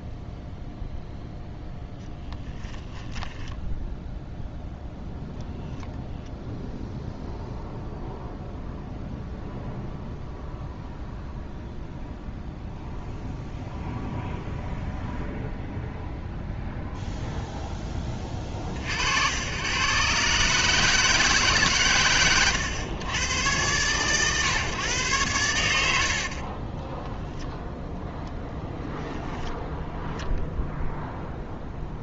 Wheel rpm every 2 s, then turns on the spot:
0, 10, 0, 0, 0, 0, 0, 0, 0, 40, 150, 110, 120, 20, 0, 0.
2-4 26-28